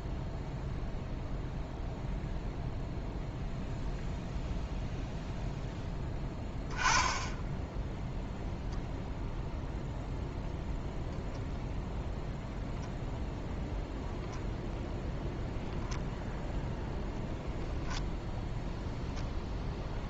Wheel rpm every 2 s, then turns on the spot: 0, 0, 0, 10, 0, 0, 0, 0, 0, 0.
none